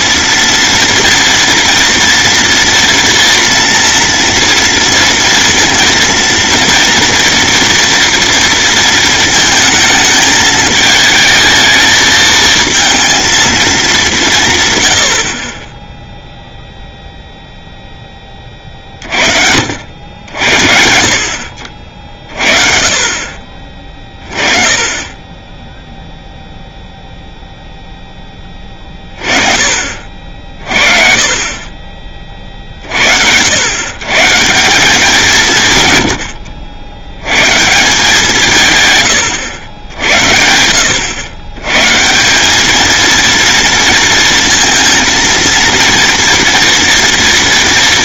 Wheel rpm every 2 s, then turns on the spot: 230, 230, 230, 240, 230, 220, 230, 100, 0, 40, 70, 40, 20, 0, 10, 50, 40, 170, 80, 170, 120, 200, 230, 230.
none